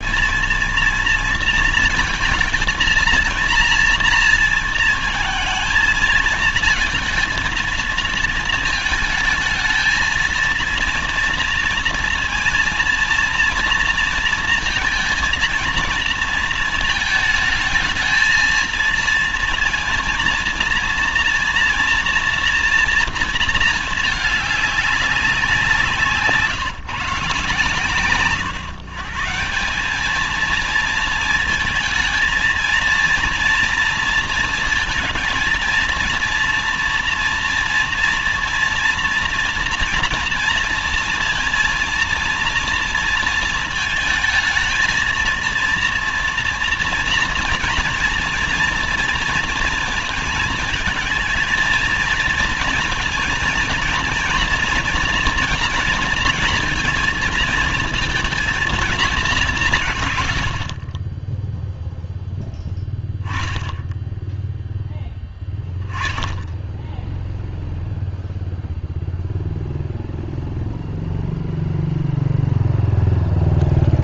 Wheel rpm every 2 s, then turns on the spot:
220, 230, 230, 220, 220, 230, 240, 230, 230, 230, 230, 230, 210, 150, 130, 220, 230, 230, 240, 240, 230, 230, 230, 230, 230, 230, 230, 240, 230, 220, 60, 0, 10, 10, 0, 0, 0.
none